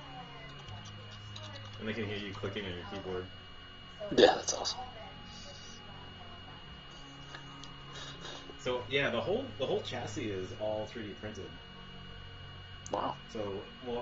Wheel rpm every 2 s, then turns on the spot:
0, 0, 0, 0, 0, 0, 0.
none